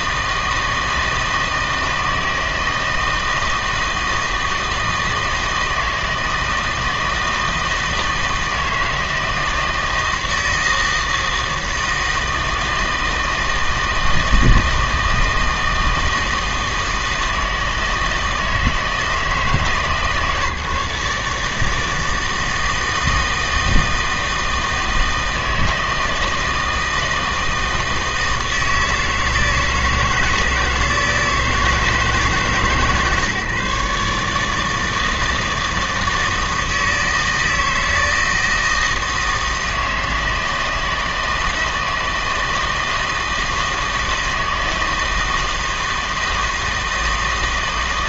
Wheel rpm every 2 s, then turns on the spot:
160, 160, 160, 160, 160, 160, 160, 160, 160, 160, 150, 160, 160, 160, 160, 160, 140, 160, 160, 160, 160, 160, 160, 160.
none